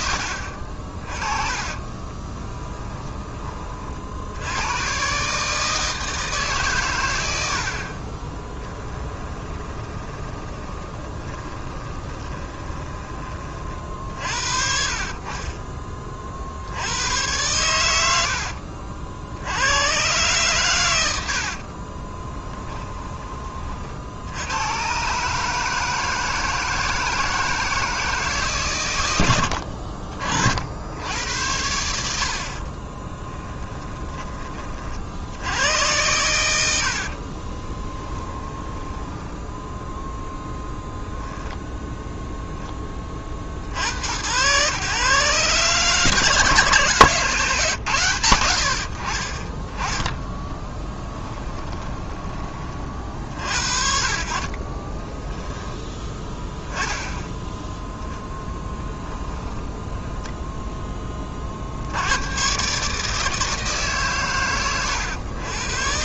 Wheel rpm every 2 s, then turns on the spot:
50, 10, 120, 120, 10, 20, 20, 40, 90, 60, 110, 20, 120, 160, 110, 70, 30, 50, 70, 10, 0, 10, 120, 160, 60, 20, 40, 30, 10, 10, 10, 150, 110.
8-14 22-24 32-34 36-40 50-52 54-56